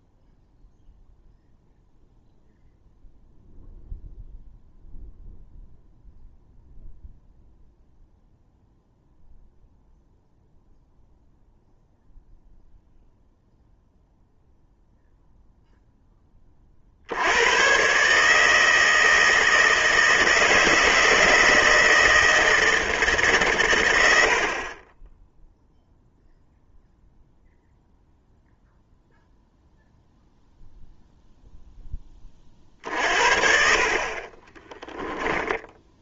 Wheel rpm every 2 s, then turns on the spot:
0, 0, 0, 0, 0, 0, 0, 0, 40, 160, 160, 160, 40, 0, 0, 0, 40, 20.
34-36